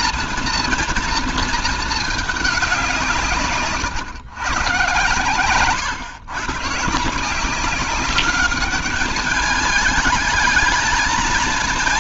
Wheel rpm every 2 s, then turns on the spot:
240, 210, 130, 130, 200, 220.
none